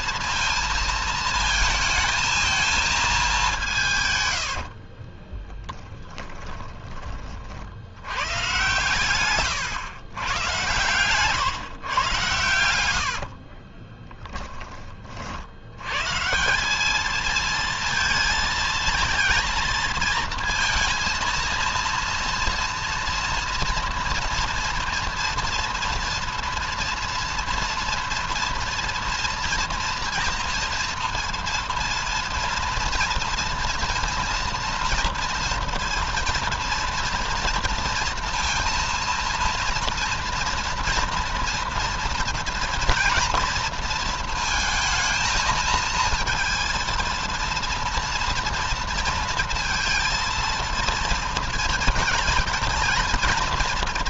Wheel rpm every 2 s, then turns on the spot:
220, 220, 50, 30, 130, 110, 60, 30, 200, 230, 230, 230, 230, 230, 230, 230, 230, 230, 230, 230, 230, 230, 220, 230, 230, 230, 230.
4-6 8-10 12-14